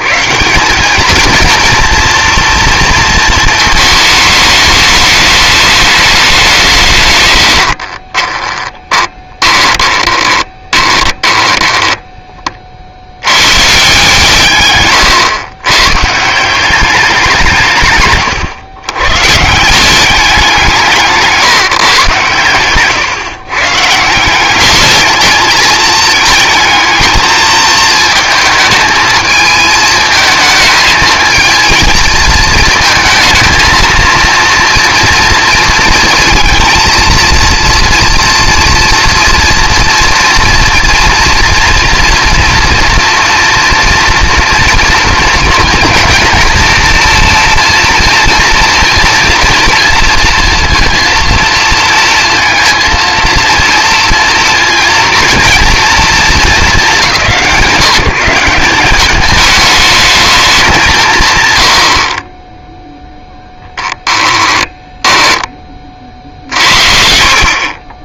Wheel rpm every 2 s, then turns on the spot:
170, 230, 210, 170, 20, 20, 30, 130, 180, 120, 180, 120, 200, 220, 220, 220, 230, 230, 230, 230, 240, 230, 230, 230, 230, 230, 230, 230, 230, 200, 200, 10, 10, 50.
8-12 22-24 64-68